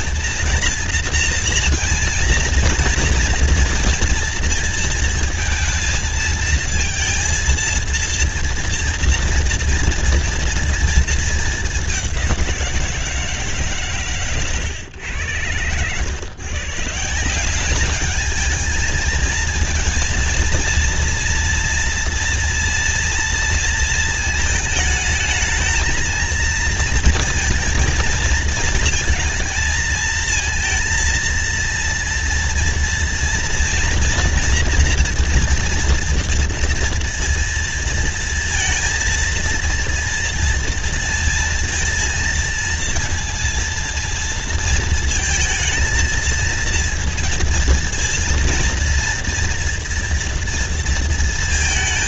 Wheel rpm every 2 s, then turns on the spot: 230, 230, 230, 230, 230, 230, 180, 120, 140, 220, 230, 230, 220, 230, 230, 230, 230, 240, 230, 230, 230, 230, 230, 220, 230, 230.
none